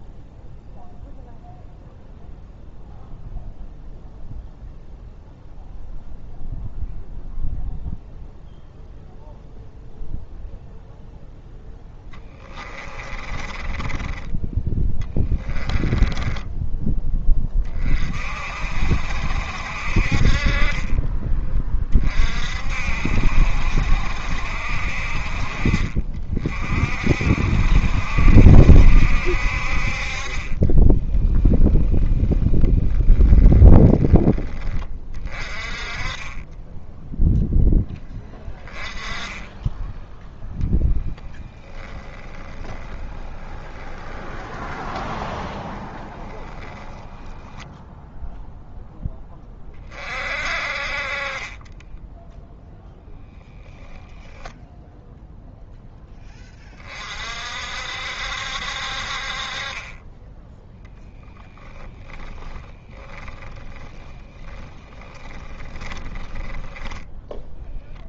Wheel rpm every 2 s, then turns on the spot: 0, 0, 0, 0, 0, 0, 20, 10, 10, 60, 30, 60, 60, 50, 70, 10, 20, 20, 10, 20, 10, 10, 10, 10, 10, 40, 0, 0, 30, 50, 0, 10, 20, 10.
12-16 30-34 40-46 62-68